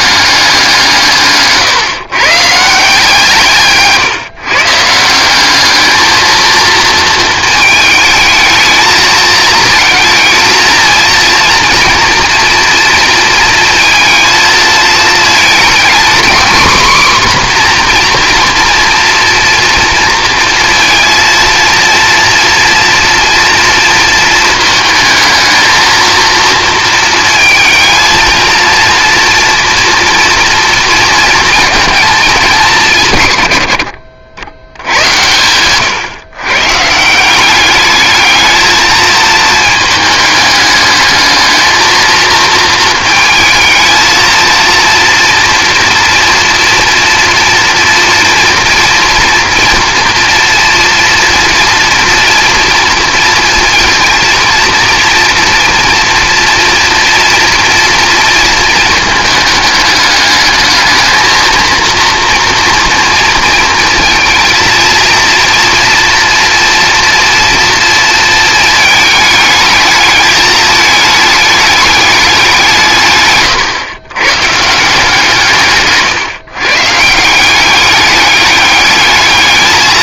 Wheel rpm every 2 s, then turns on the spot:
160, 160, 160, 230, 220, 230, 230, 220, 250, 240, 230, 230, 220, 230, 230, 230, 180, 90, 140, 220, 210, 230, 230, 230, 230, 230, 230, 240, 230, 220, 220, 230, 230, 230, 220, 210, 150, 150, 140, 210.
none